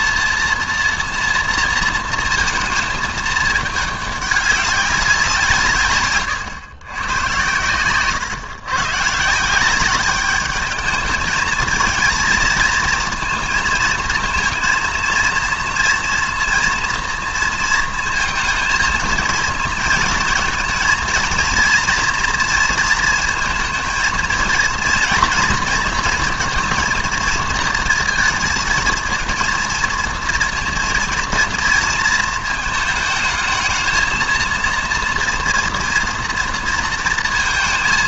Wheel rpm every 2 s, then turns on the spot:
240, 220, 200, 110, 130, 210, 220, 230, 230, 220, 230, 230, 230, 230, 220, 230, 220, 230, 230.
none